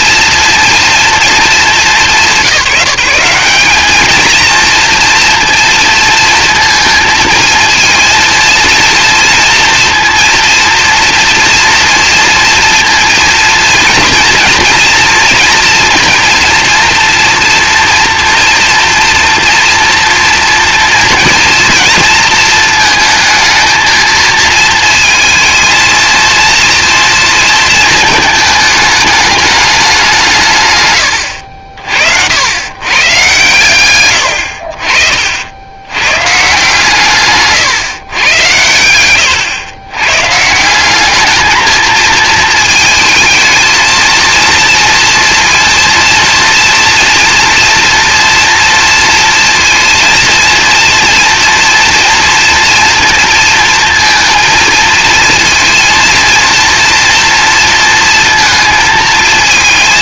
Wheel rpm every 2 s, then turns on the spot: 230, 170, 230, 230, 230, 230, 230, 240, 230, 240, 230, 230, 220, 230, 220, 130, 120, 50, 150, 90, 180, 220, 230, 230, 230, 230, 230, 230, 230, 220.
38-40